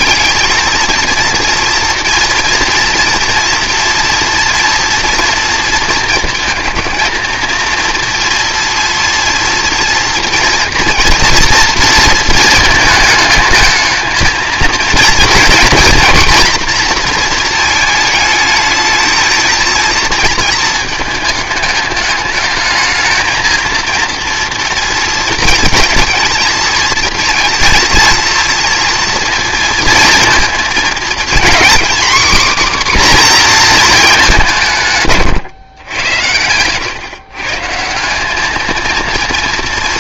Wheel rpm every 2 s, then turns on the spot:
220, 230, 230, 220, 230, 230, 220, 230, 240, 220, 220, 210, 230, 220, 230, 230, 260, 170, 110, 220.
none